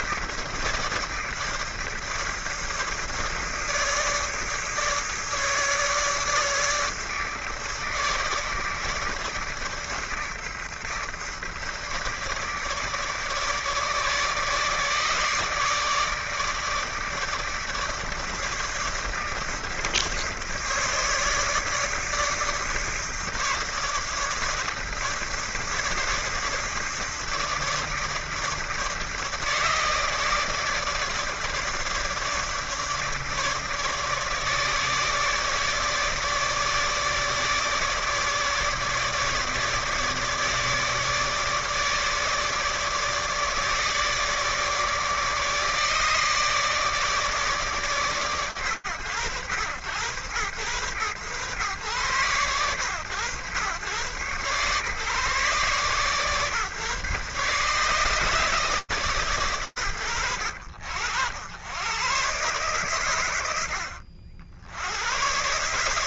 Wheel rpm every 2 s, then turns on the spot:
150, 150, 150, 150, 150, 150, 150, 150, 150, 150, 150, 150, 150, 150, 160, 150, 160, 150, 150, 150, 150, 150, 150, 150, 100, 110, 110, 140, 130, 140, 80, 100, 110.
none